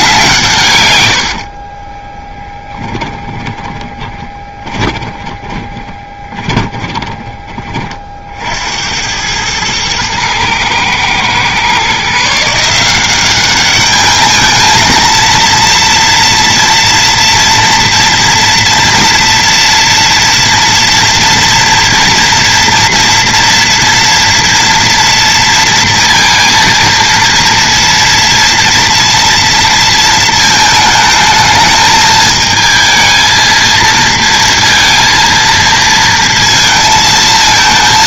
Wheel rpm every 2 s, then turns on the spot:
110, 10, 10, 20, 70, 110, 170, 220, 230, 230, 230, 230, 230, 230, 230, 220, 220, 230, 230.
2-8